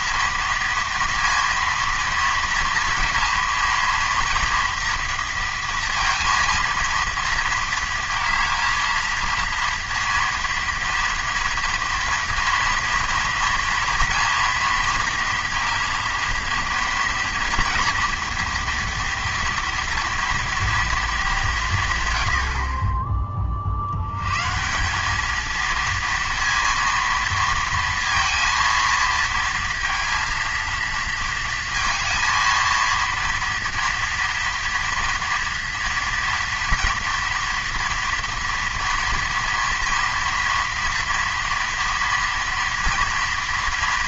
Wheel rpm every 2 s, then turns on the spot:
230, 230, 230, 230, 230, 230, 230, 230, 230, 230, 230, 60, 150, 230, 230, 230, 230, 230, 230, 230, 230, 230.
none